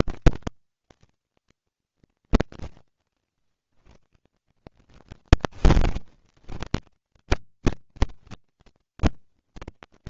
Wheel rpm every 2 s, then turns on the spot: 110, 130, 130, 100, 100.
none